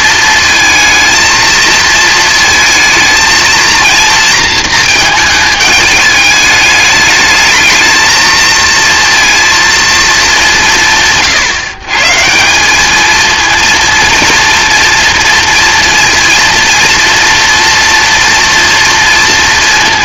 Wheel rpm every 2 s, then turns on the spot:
230, 220, 220, 210, 230, 170, 210, 230, 230, 230.
none